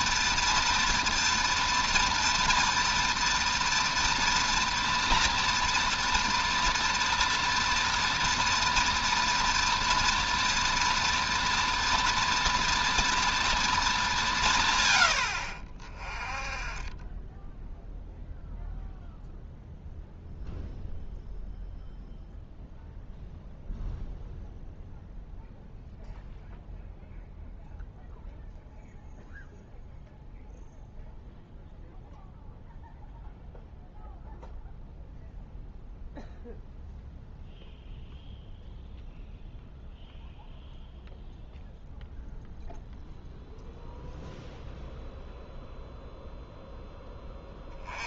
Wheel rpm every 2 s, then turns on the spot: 240, 230, 230, 240, 230, 230, 230, 150, 20, 0, 0, 0, 0, 0, 0, 0, 0, 0, 0, 0, 0, 0, 0, 0.
none